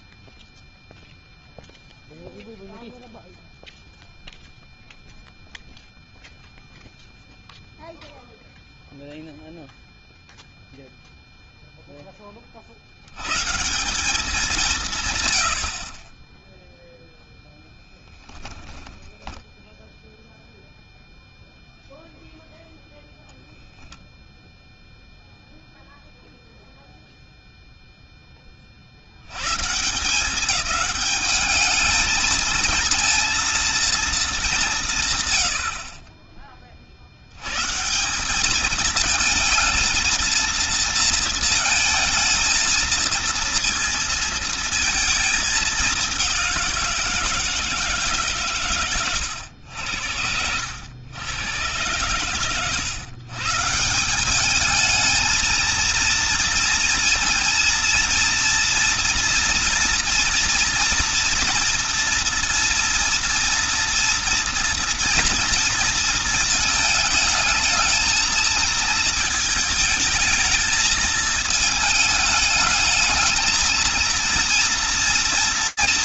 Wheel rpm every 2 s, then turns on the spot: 0, 0, 0, 0, 0, 0, 90, 170, 0, 10, 0, 0, 0, 0, 10, 180, 230, 180, 30, 200, 230, 230, 230, 190, 140, 90, 100, 200, 230, 230, 230, 230, 230, 220, 220, 220, 220, 230.
18-20